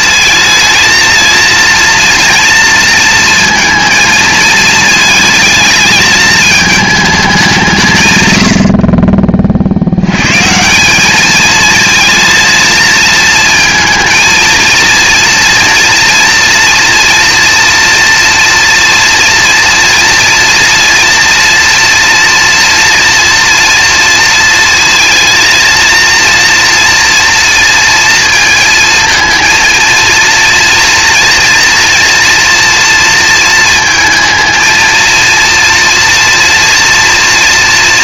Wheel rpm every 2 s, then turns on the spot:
230, 230, 220, 220, 70, 170, 220, 230, 230, 230, 230, 240, 230, 240, 230, 230, 230, 230, 240.
none